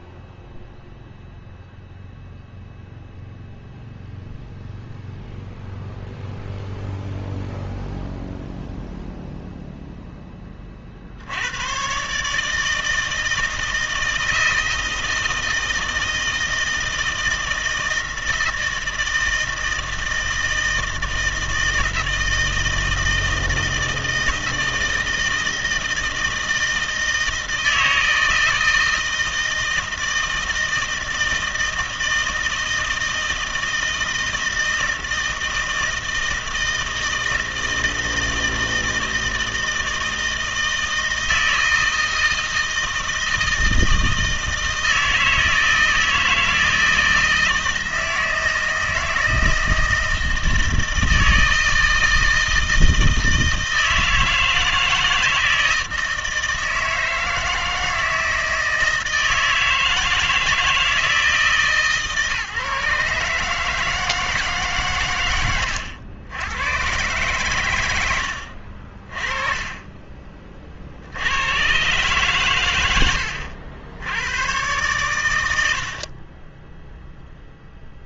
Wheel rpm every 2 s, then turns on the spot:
0, 0, 0, 0, 0, 40, 160, 160, 160, 160, 160, 160, 160, 160, 160, 160, 160, 160, 160, 160, 160, 160, 160, 160, 160, 160, 160, 160, 160, 160, 170, 150, 140, 110, 60, 40, 100, 120, 10.
none